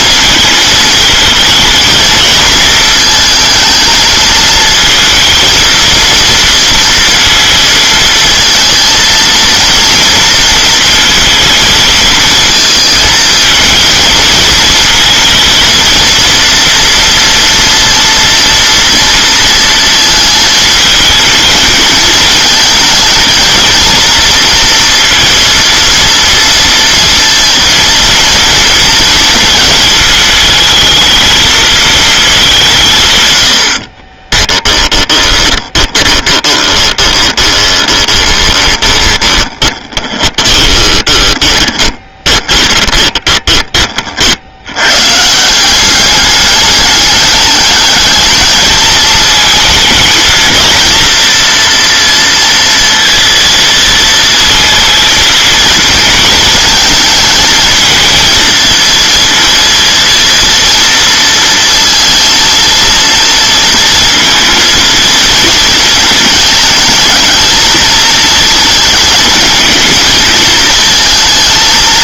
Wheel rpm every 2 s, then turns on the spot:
220, 220, 220, 230, 230, 230, 220, 220, 230, 230, 220, 230, 230, 230, 230, 220, 170, 10, 20, 20, 20, 20, 90, 210, 220, 230, 230, 230, 220, 230, 230, 230, 230, 220, 220, 230.
34-44